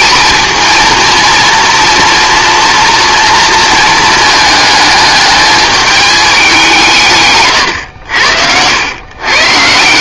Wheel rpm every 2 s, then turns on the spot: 230, 240, 220, 180, 90.
none